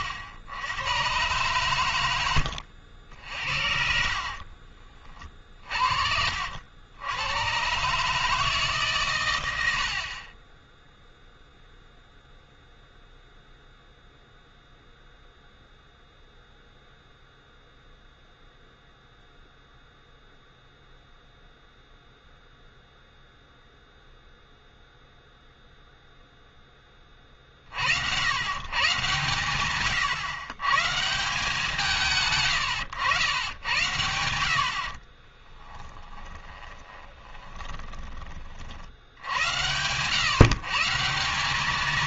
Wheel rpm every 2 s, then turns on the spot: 90, 90, 50, 70, 150, 20, 0, 0, 0, 0, 0, 0, 0, 10, 130, 120, 120, 60, 10, 60, 130.
4-6 36-38